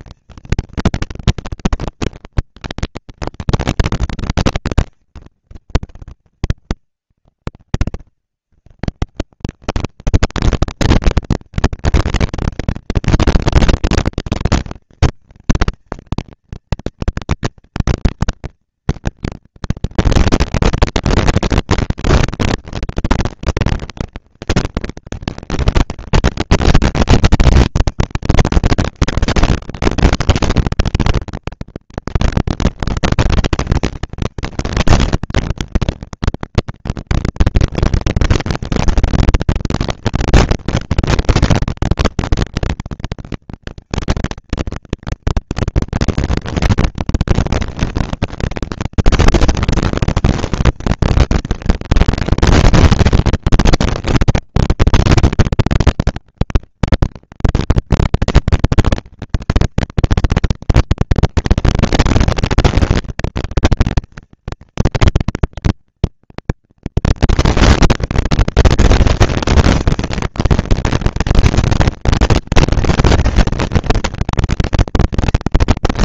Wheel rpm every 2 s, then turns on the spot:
230, 230, 200, 120, 160, 230, 230, 230, 230, 230, 230, 230, 230, 230, 230, 240, 230, 230, 230, 230, 230, 230, 230, 240, 230, 220, 200, 190, 210, 230, 230, 230, 230, 240, 230, 230, 230, 230.
none